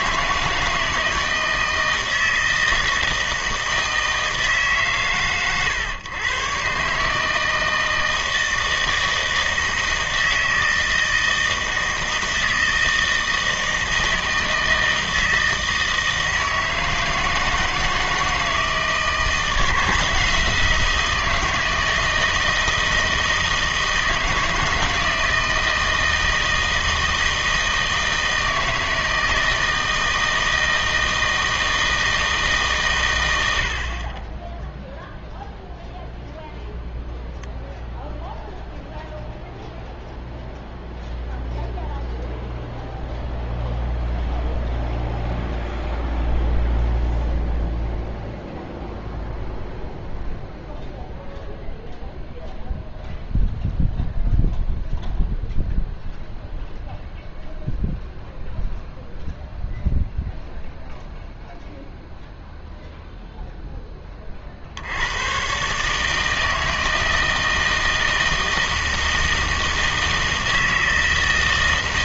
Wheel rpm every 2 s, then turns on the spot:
160, 160, 150, 140, 160, 160, 160, 160, 160, 160, 170, 160, 160, 160, 160, 160, 130, 0, 0, 0, 0, 0, 0, 0, 0, 0, 0, 0, 0, 0, 0, 0, 60, 160, 160, 160.
none